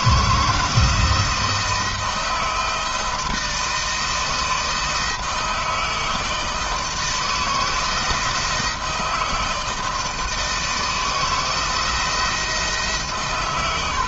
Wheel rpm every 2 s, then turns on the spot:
160, 170, 160, 160, 160, 160, 140.
none